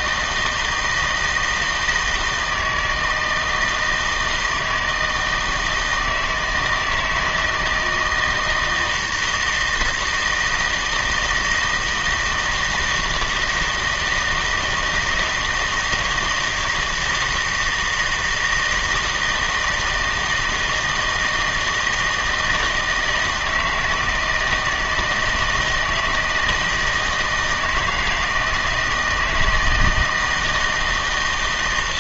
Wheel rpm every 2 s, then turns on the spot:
160, 160, 160, 160, 170, 160, 160, 160, 160, 160, 160, 160, 160, 160, 160, 160.
none